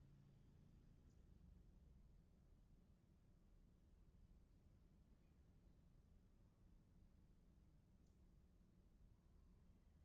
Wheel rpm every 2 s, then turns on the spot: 0, 0, 0, 0, 0.
none